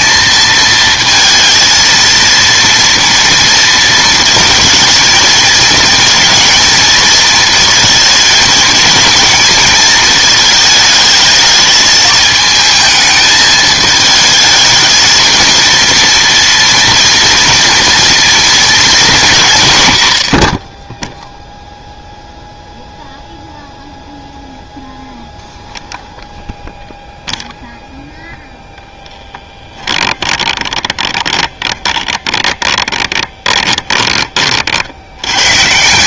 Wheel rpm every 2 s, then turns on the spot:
220, 230, 230, 220, 220, 220, 220, 220, 240, 220, 30, 0, 0, 0, 0, 20, 20, 50.
30-34